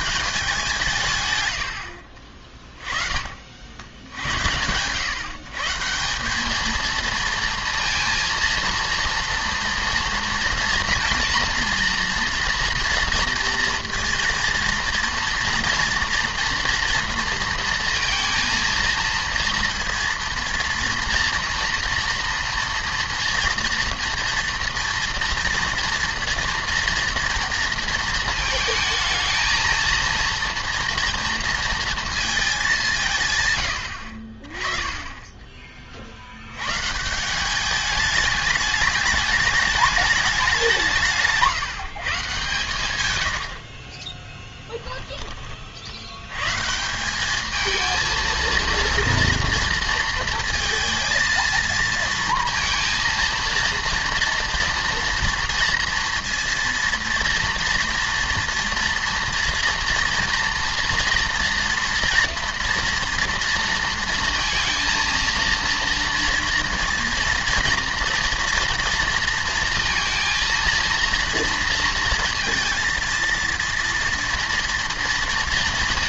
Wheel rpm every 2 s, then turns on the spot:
170, 20, 100, 220, 230, 230, 230, 230, 230, 230, 230, 230, 230, 240, 230, 230, 210, 30, 110, 210, 180, 130, 10, 150, 230, 230, 230, 230, 230, 230, 230, 230, 230, 230, 240, 230, 230, 230.
44-46